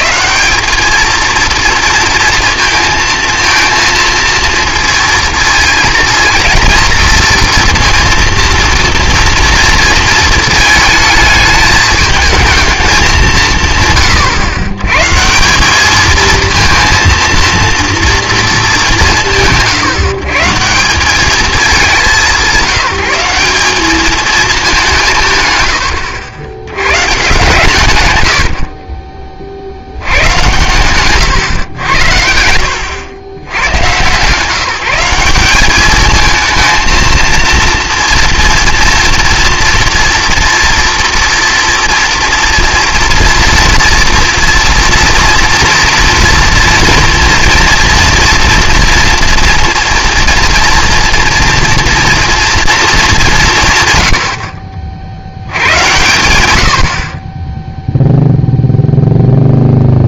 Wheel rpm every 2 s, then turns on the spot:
220, 230, 230, 230, 230, 220, 220, 120, 230, 190, 180, 190, 180, 110, 50, 120, 110, 180, 230, 230, 240, 230, 240, 230, 230, 230, 200, 70, 40, 0.
none